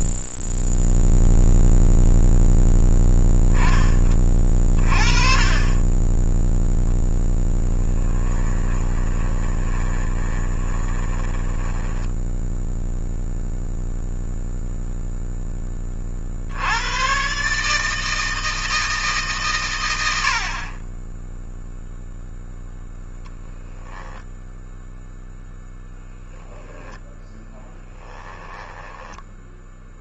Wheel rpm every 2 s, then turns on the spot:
0, 0, 20, 20, 10, 20, 0, 0, 70, 160, 40, 0, 0, 10, 10.
8-12 26-30